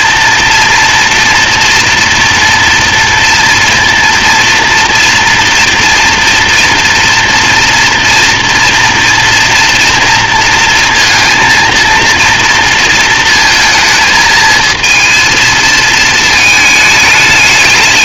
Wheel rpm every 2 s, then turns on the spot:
230, 230, 230, 230, 230, 230, 230, 220, 220.
none